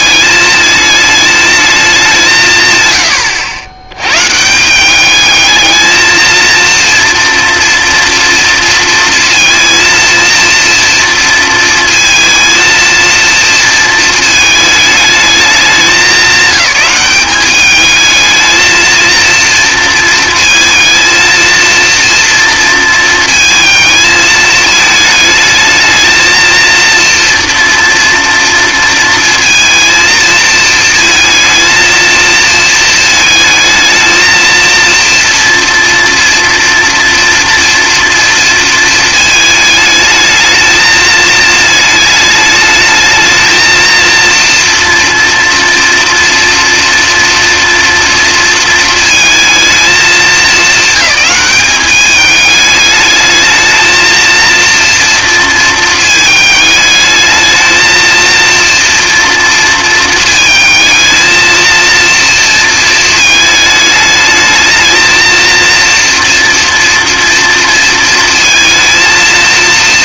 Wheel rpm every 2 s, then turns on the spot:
220, 110, 190, 230, 230, 230, 230, 220, 200, 230, 230, 230, 220, 230, 230, 230, 220, 230, 230, 230, 220, 220, 240, 230, 220, 210, 210, 230, 210, 230, 220, 220, 220, 230, 230.
none